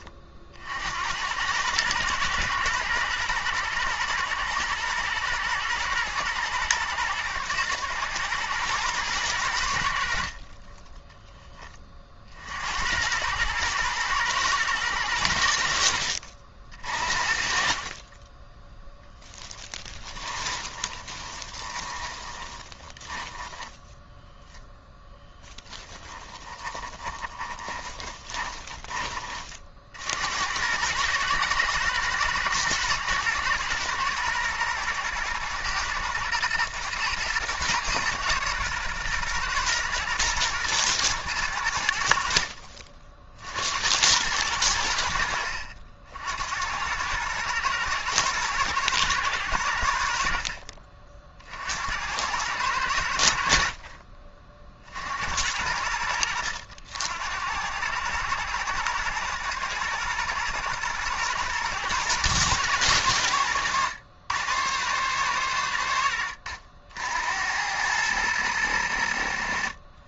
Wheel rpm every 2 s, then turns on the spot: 60, 110, 120, 120, 110, 20, 70, 110, 50, 10, 20, 10, 0, 20, 30, 100, 120, 110, 110, 120, 110, 50, 80, 90, 120, 50, 100, 40, 80, 110, 110, 110, 120, 80, 90.
20-24 26-30